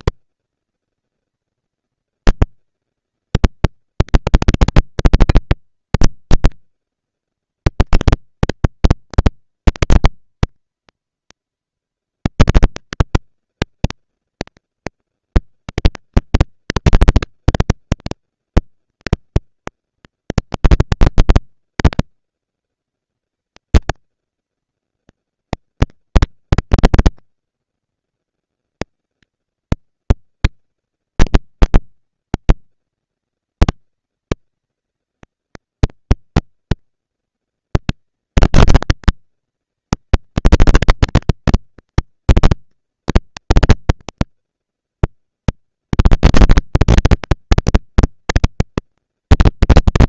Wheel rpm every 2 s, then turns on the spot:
230, 230, 220, 220, 230, 230, 230, 200, 200, 230, 230, 230, 230, 230, 230, 220, 200, 190, 230, 230, 230, 240, 230, 230, 230.
none